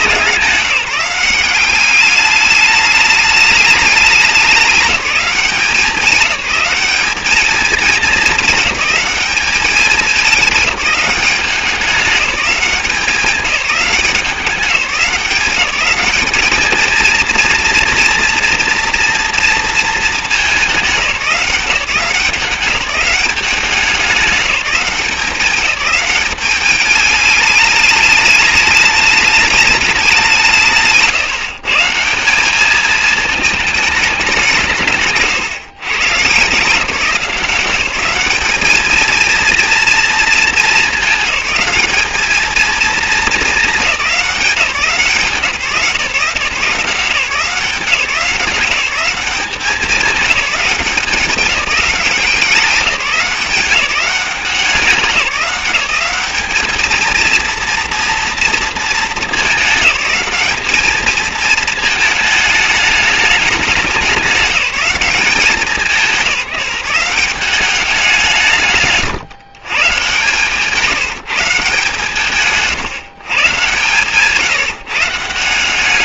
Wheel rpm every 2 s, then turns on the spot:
180, 210, 200, 190, 210, 200, 190, 190, 210, 230, 200, 180, 190, 200, 210, 170, 200, 180, 150, 210, 220, 220, 180, 170, 180, 200, 190, 180, 200, 230, 210, 210, 200, 180, 150, 150, 150, 150.
none